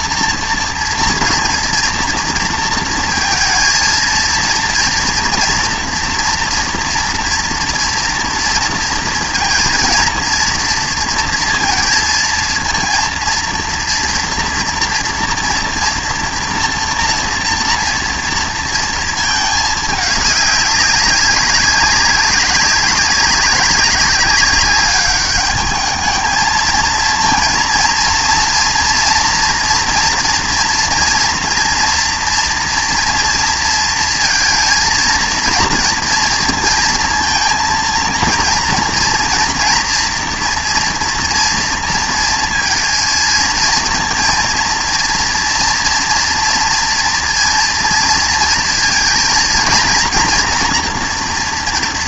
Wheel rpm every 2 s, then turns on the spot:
230, 230, 230, 230, 230, 230, 230, 240, 230, 230, 200, 200, 200, 220, 230, 230, 230, 230, 230, 230, 240, 230, 230, 230, 230, 230.
none